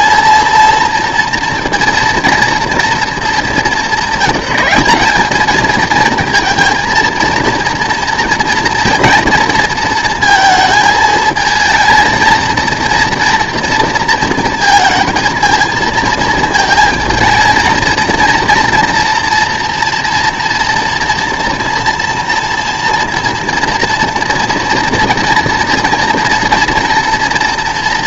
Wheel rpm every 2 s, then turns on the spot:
230, 230, 200, 230, 230, 220, 230, 230, 230, 230, 230, 230, 230, 240.
none